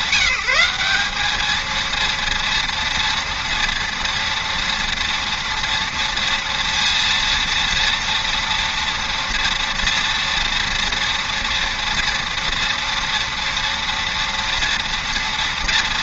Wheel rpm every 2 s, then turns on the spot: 190, 230, 230, 230, 230, 230, 230, 230.
none